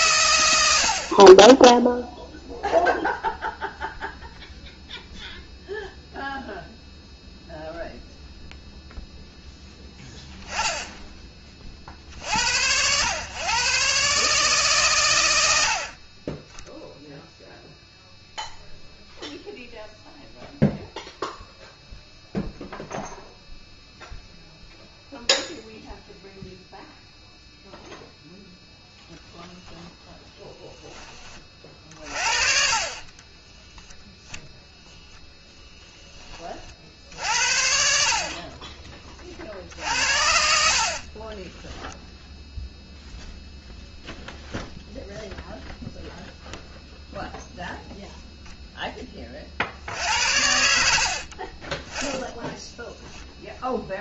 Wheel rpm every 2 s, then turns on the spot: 90, 0, 0, 0, 0, 10, 80, 140, 10, 0, 0, 0, 0, 0, 0, 10, 40, 0, 40, 30, 60, 0, 0, 0, 0, 70, 10.
none